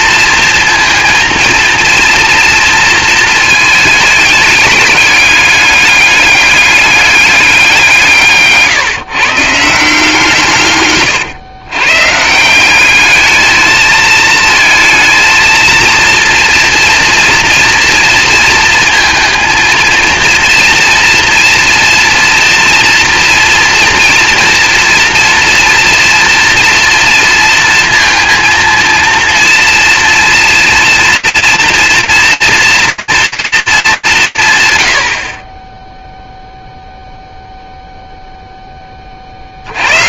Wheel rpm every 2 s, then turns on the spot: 230, 230, 200, 210, 140, 140, 190, 220, 230, 230, 230, 230, 230, 240, 230, 230, 230, 90, 0, 30.
none